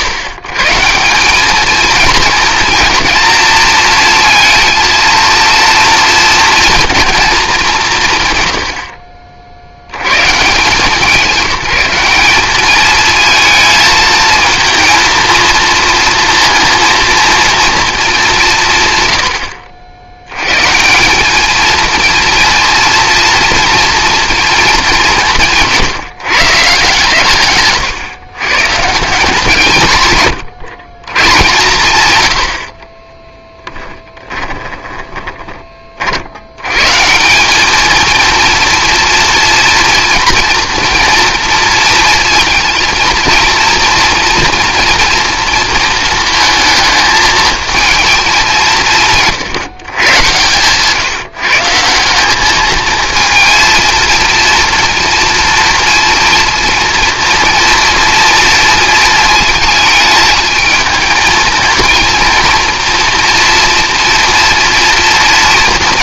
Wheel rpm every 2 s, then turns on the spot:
150, 220, 230, 230, 80, 160, 210, 230, 230, 150, 160, 230, 190, 140, 150, 130, 50, 20, 130, 230, 230, 230, 240, 220, 170, 140, 220, 230, 230, 230, 220, 230, 230.
8-10 32-36